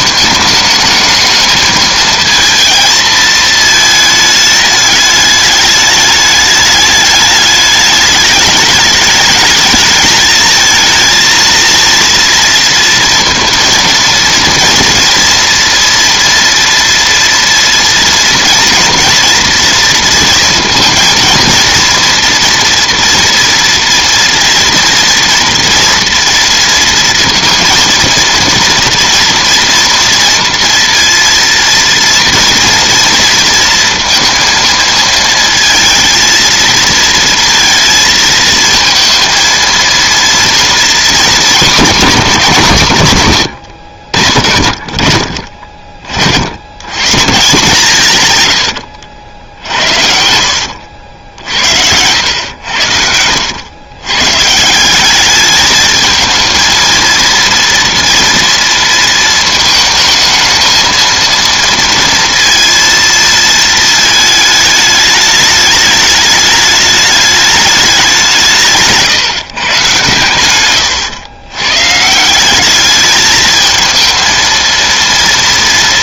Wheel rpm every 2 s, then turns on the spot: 210, 230, 210, 210, 210, 220, 230, 230, 230, 230, 230, 230, 230, 230, 230, 230, 230, 230, 230, 220, 230, 160, 60, 90, 100, 80, 90, 160, 220, 230, 220, 230, 210, 210, 160, 110, 190, 230.
48-52